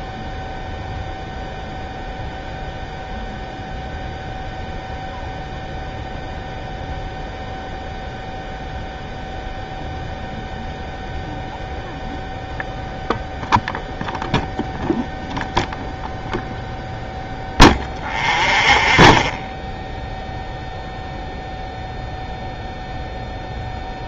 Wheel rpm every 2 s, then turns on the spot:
0, 0, 0, 0, 0, 0, 0, 0, 0, 0, 0, 0.
none